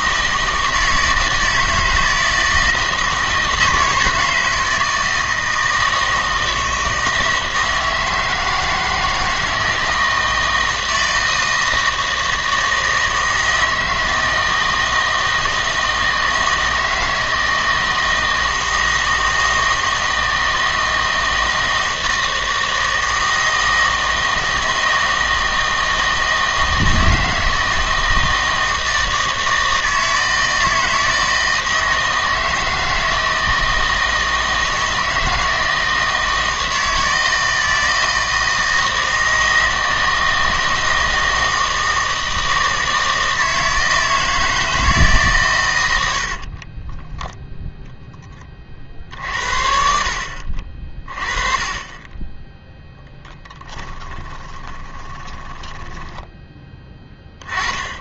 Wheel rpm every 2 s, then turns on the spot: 160, 160, 160, 160, 160, 160, 160, 160, 160, 160, 160, 160, 160, 160, 160, 160, 160, 160, 160, 160, 160, 160, 160, 40, 40, 40, 10, 20, 10.
46-48 54-56